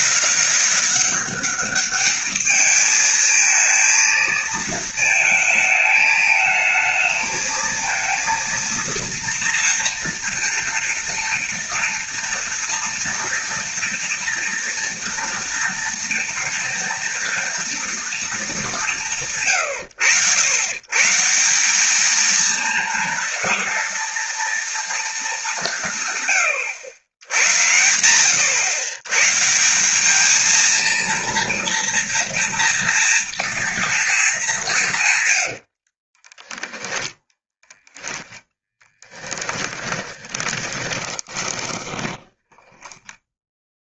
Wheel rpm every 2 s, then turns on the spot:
200, 220, 220, 220, 230, 230, 230, 230, 230, 180, 140, 230, 230, 90, 120, 230, 230, 170, 10, 10, 20, 10.
36-44